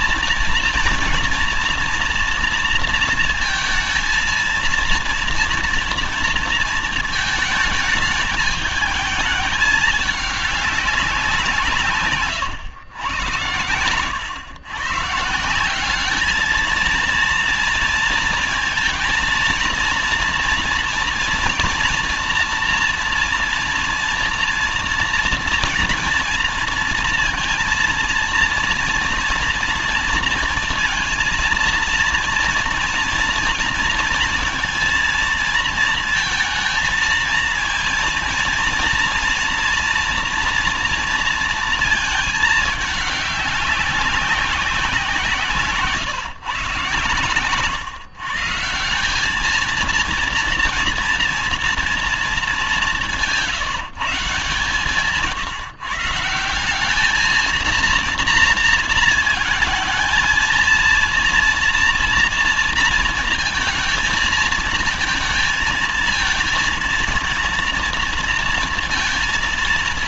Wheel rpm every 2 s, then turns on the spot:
230, 230, 230, 220, 220, 190, 110, 150, 230, 230, 230, 240, 230, 230, 230, 230, 230, 230, 230, 230, 230, 210, 170, 120, 190, 230, 190, 140, 200, 230, 230, 230, 230, 230, 230.
none